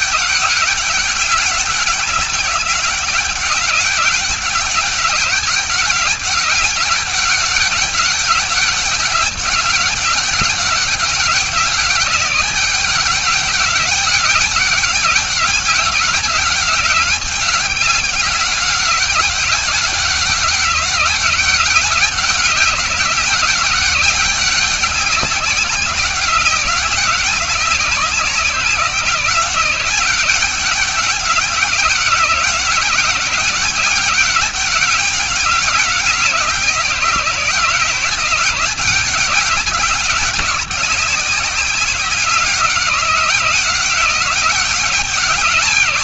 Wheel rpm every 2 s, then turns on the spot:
200, 200, 200, 200, 200, 200, 200, 200, 190, 200, 200, 190, 190, 190, 180, 190, 190, 200, 170, 190, 190, 190, 180.
none